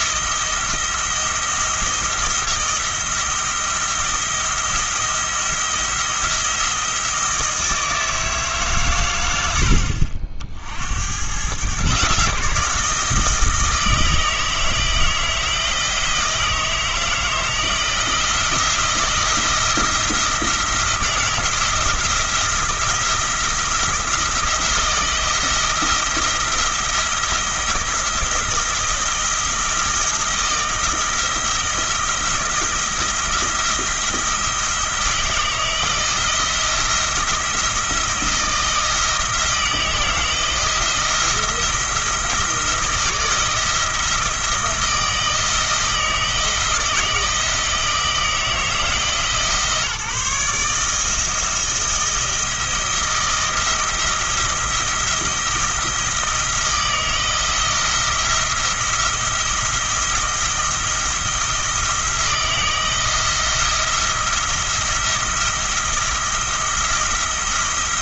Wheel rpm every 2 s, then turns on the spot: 170, 170, 170, 170, 130, 70, 160, 160, 160, 170, 160, 170, 170, 170, 170, 170, 170, 160, 170, 160, 170, 170, 160, 160, 160, 160, 170, 170, 160, 170, 170, 160, 170, 170.
none